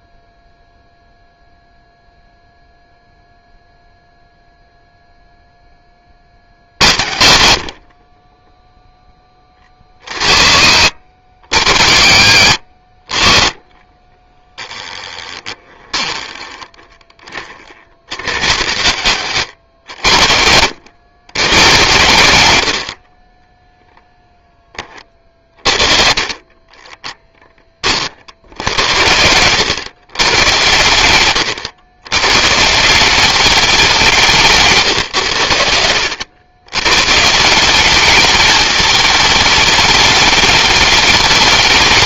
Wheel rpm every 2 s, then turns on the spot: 0, 0, 10, 80, 40, 70, 20, 20, 50, 120, 110, 10, 40, 30, 100, 110, 200, 80, 180, 220, 220.
14-16 34-36